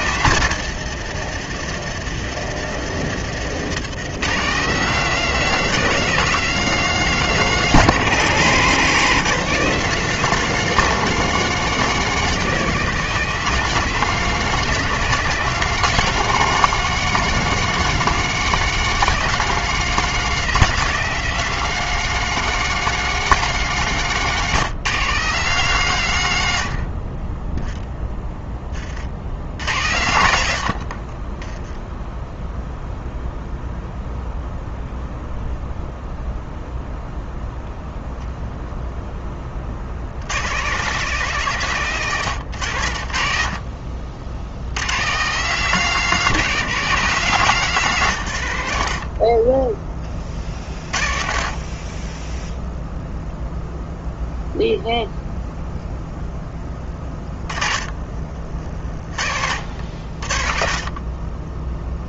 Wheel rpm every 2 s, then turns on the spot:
150, 130, 190, 200, 180, 210, 200, 210, 210, 210, 210, 210, 180, 50, 80, 40, 0, 0, 0, 10, 160, 70, 140, 190, 60, 50, 0, 0, 10, 50, 30.
none